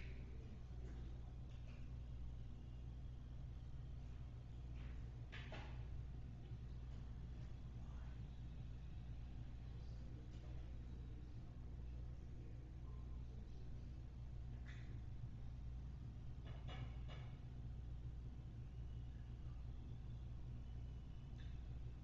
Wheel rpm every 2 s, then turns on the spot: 0, 0, 0, 0, 0, 0, 0, 0, 0, 0, 0.
none